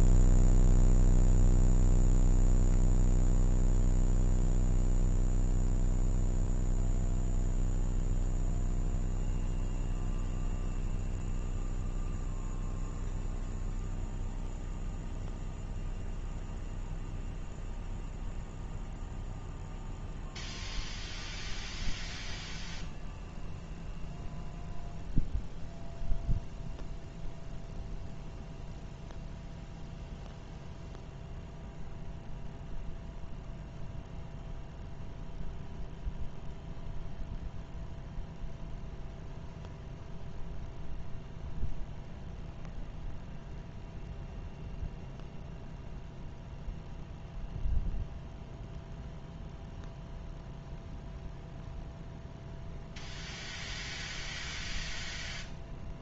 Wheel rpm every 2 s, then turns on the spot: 0, 0, 0, 0, 0, 0, 0, 0, 0, 0, 0, 0, 0, 0, 0, 0, 0, 0, 0, 0, 0, 0, 0, 0, 0, 0, 0, 0.
none